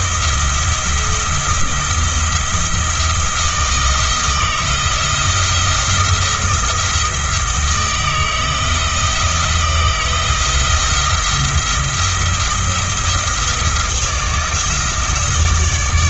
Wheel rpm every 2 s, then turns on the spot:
170, 170, 170, 170, 160, 170, 170, 160.
none